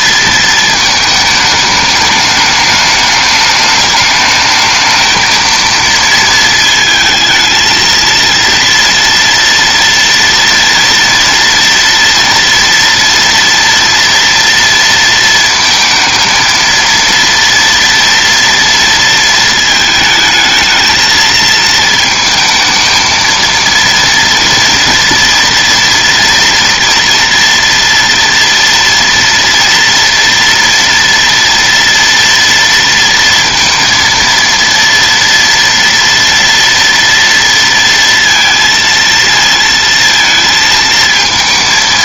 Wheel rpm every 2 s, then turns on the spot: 220, 210, 220, 220, 230, 230, 230, 230, 230, 230, 220, 220, 230, 230, 230, 230, 230, 230, 230, 230, 230.
none